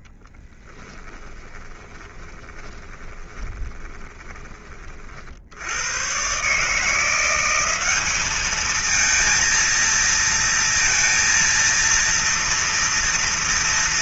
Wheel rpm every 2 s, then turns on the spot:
10, 20, 40, 160, 220, 230, 230.
0-4